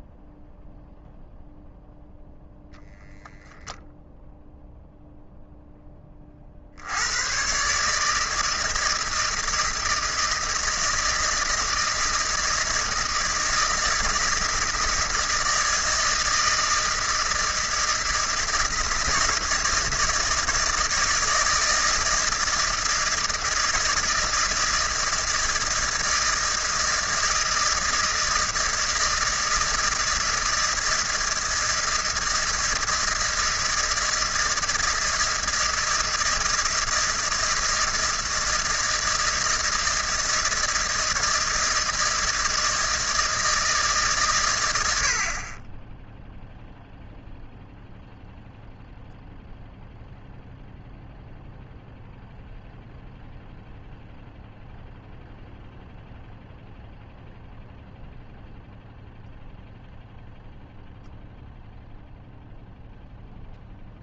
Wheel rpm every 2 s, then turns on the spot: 0, 0, 0, 50, 160, 170, 160, 160, 160, 160, 160, 160, 160, 160, 160, 160, 160, 160, 160, 160, 160, 160, 110, 0, 0, 0, 0, 0, 0, 0, 0, 0.
none